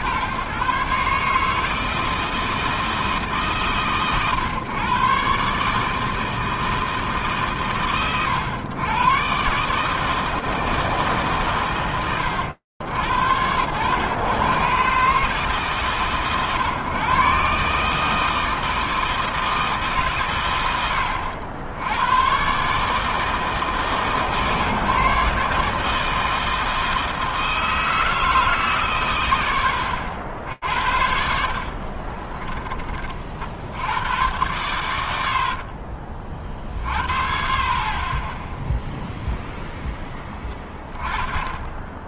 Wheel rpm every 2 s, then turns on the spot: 120, 160, 130, 160, 100, 160, 100, 120, 130, 160, 90, 130, 140, 160, 140, 70, 20, 120, 40, 10, 20.
32-34